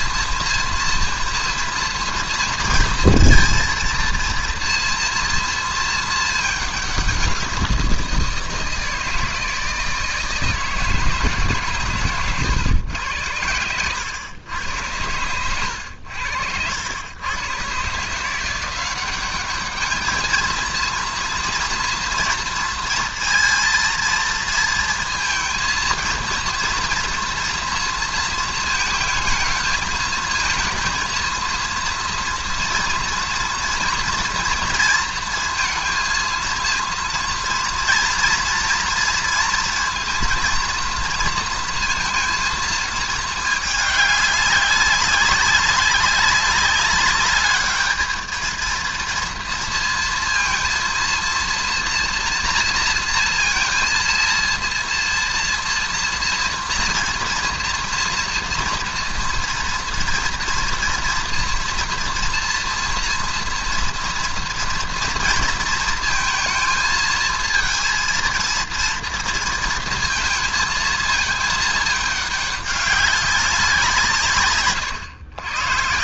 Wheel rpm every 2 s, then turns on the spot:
230, 230, 230, 210, 160, 160, 110, 100, 80, 170, 220, 230, 230, 230, 220, 220, 240, 230, 230, 230, 230, 230, 200, 200, 230, 230, 240, 230, 230, 230, 230, 240, 230, 230, 230, 230, 200, 150.
none